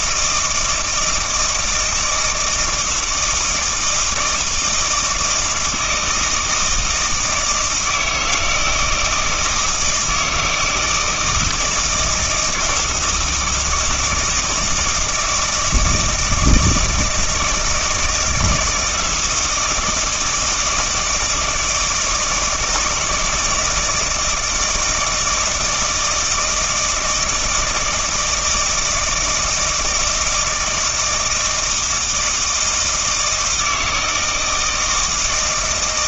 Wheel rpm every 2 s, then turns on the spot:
160, 160, 160, 160, 160, 160, 160, 160, 160, 160, 170, 160, 160, 160, 160, 160, 160, 160.
none